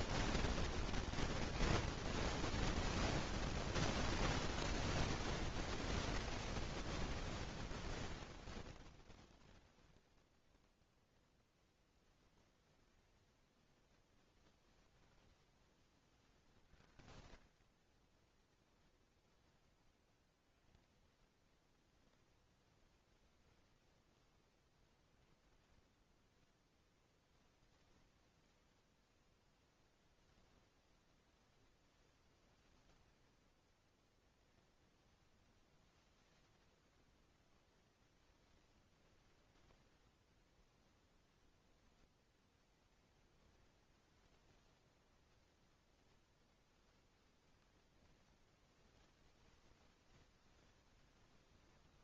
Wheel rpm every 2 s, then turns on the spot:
20, 0, 0, 0, 0, 0, 0, 20, 50, 0, 10, 0, 10, 0, 0, 0, 10, 0, 0, 10, 0, 0, 0, 0, 0, 0.
none